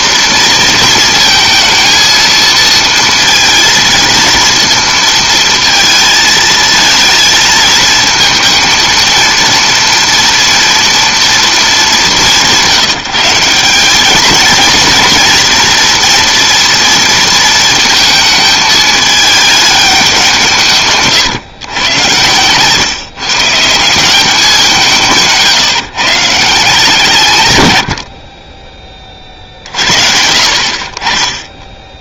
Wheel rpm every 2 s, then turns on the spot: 240, 230, 230, 220, 230, 230, 170, 230, 230, 220, 160, 130, 180, 150, 20, 60.
none